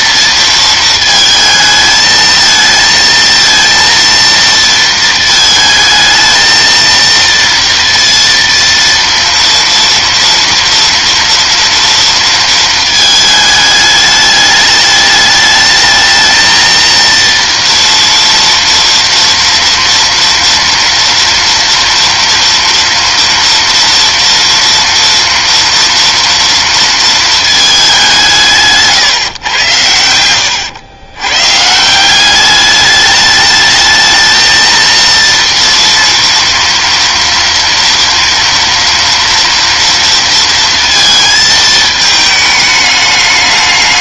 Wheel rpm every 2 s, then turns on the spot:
230, 220, 230, 230, 230, 230, 220, 210, 230, 230, 230, 230, 230, 230, 160, 90, 200, 230, 230, 230, 230, 210.
none